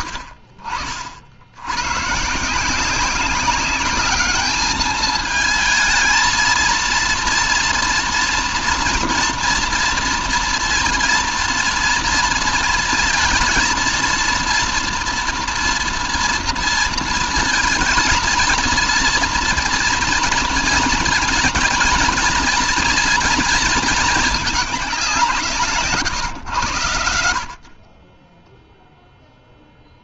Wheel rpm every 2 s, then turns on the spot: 90, 170, 210, 230, 230, 230, 230, 230, 230, 230, 230, 240, 210, 110, 10.
none